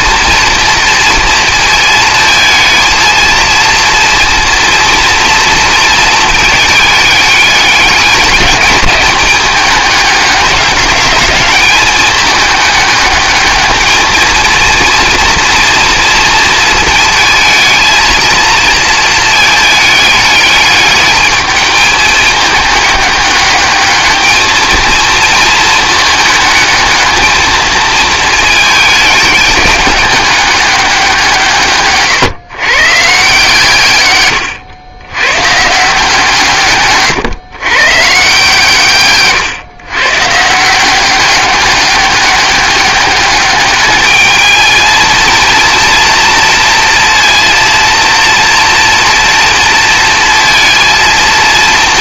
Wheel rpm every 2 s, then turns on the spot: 230, 220, 230, 210, 210, 200, 210, 230, 220, 230, 210, 210, 220, 220, 220, 200, 140, 100, 140, 140, 170, 200, 220, 230, 230, 230.
none